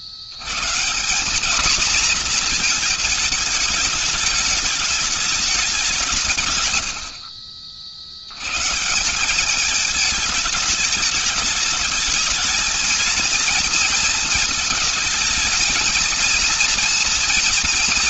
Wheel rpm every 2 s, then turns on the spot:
80, 230, 210, 160, 90, 220, 220, 220, 230.
none